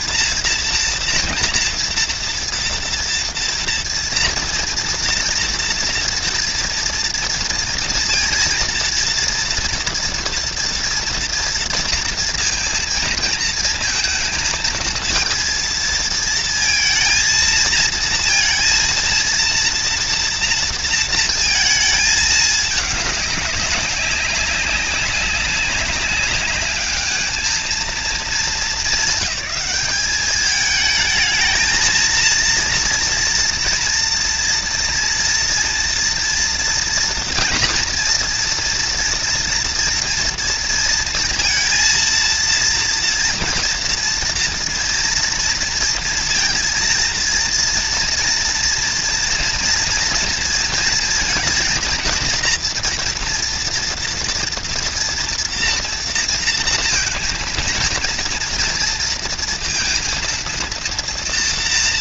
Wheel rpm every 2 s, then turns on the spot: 230, 230, 230, 230, 230, 230, 230, 230, 230, 230, 230, 210, 190, 200, 200, 210, 230, 240, 230, 230, 230, 230, 230, 230, 230, 230, 240, 240, 230, 230, 230.
none